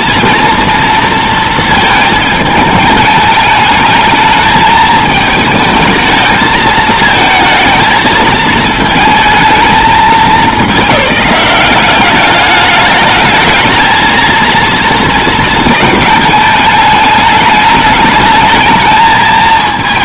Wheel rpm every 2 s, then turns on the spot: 230, 220, 220, 220, 220, 190, 210, 230, 210, 220.
none